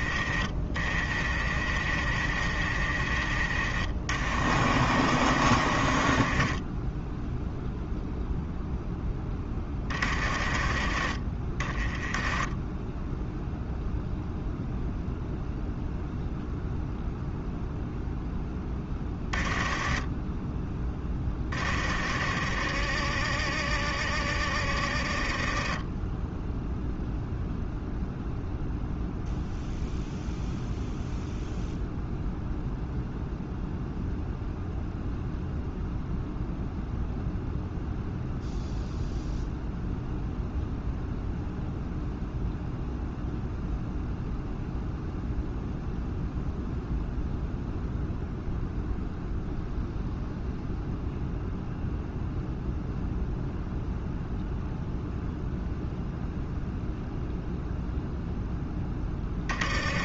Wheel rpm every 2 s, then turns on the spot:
40, 40, 50, 10, 0, 30, 10, 0, 0, 10, 10, 50, 40, 0, 0, 0, 0, 0, 0, 0, 0, 0, 0, 0, 0, 0, 0, 0, 0, 10.
none